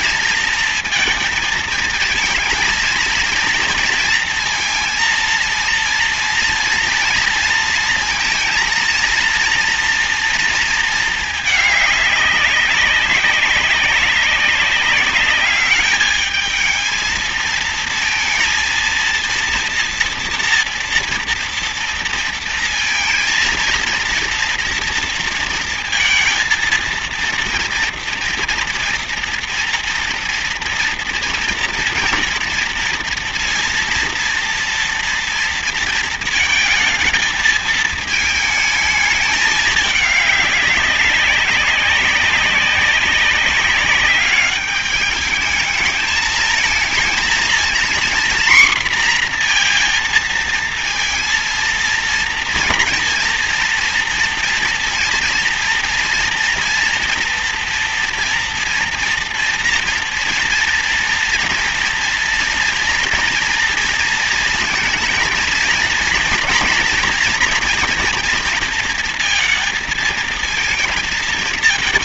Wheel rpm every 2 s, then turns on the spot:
230, 230, 230, 230, 230, 220, 200, 200, 220, 230, 230, 230, 230, 230, 240, 240, 240, 230, 220, 220, 200, 190, 200, 220, 240, 230, 230, 230, 230, 240, 240, 230, 230, 230, 230, 220.
none